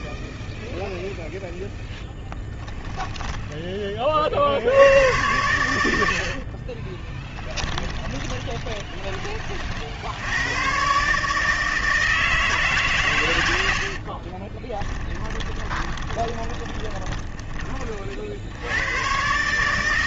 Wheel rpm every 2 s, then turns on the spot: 0, 10, 110, 30, 20, 130, 110, 10, 20, 100.
6-8 16-18